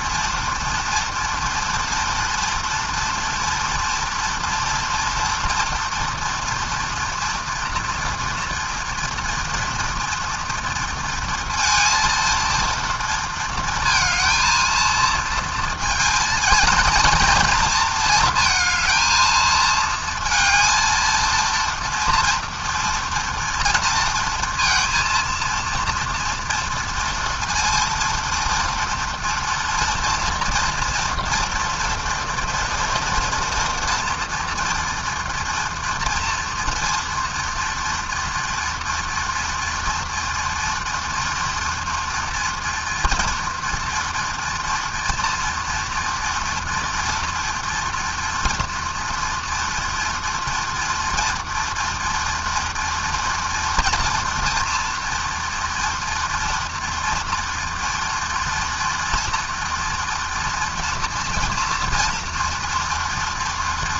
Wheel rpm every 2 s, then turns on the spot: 230, 230, 230, 230, 230, 230, 230, 230, 230, 220, 230, 230, 230, 230, 230, 240, 240, 230, 230, 230, 230, 230, 230, 230, 230, 230, 230, 230, 230, 230, 230, 230.
none